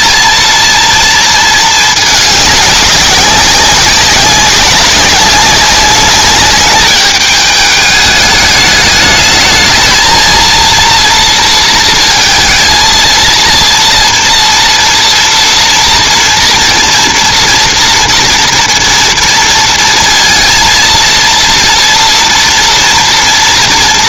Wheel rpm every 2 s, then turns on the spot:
230, 200, 190, 200, 210, 230, 230, 230, 240, 230, 230, 230.
none